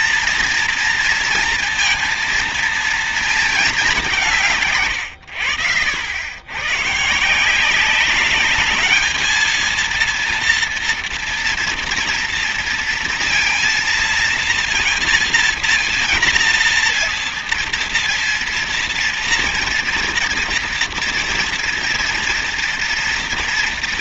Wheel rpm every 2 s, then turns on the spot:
240, 230, 110, 130, 210, 230, 230, 230, 230, 230, 230, 230.
none